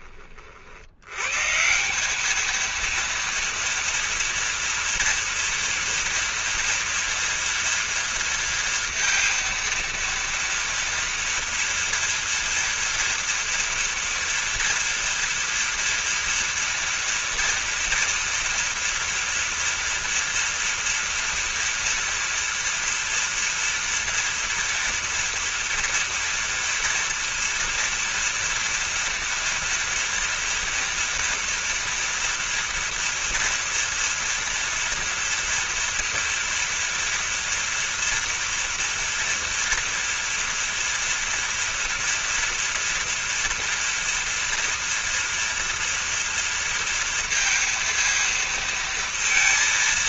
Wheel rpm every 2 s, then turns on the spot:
60, 230, 230, 230, 230, 230, 230, 240, 230, 230, 240, 240, 230, 230, 230, 230, 230, 230, 240, 240, 230, 230, 230, 230, 230.
none